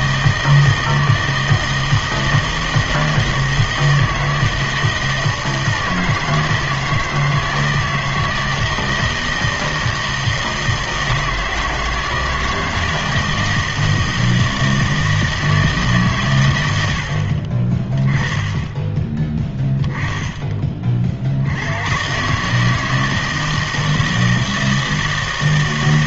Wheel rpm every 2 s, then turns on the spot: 160, 160, 160, 160, 160, 160, 160, 160, 90, 20, 30, 160, 160.
none